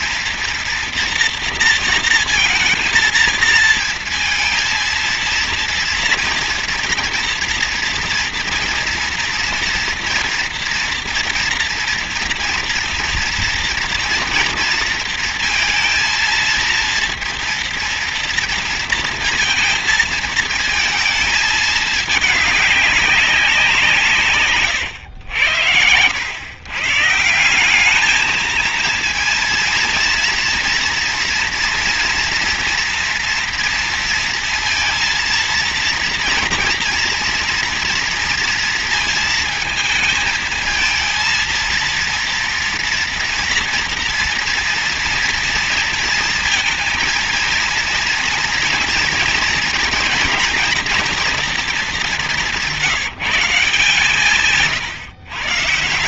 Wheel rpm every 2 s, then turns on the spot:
230, 230, 230, 240, 230, 240, 230, 230, 230, 230, 220, 200, 110, 150, 230, 230, 230, 230, 230, 230, 230, 230, 230, 230, 230, 230, 180, 150.
none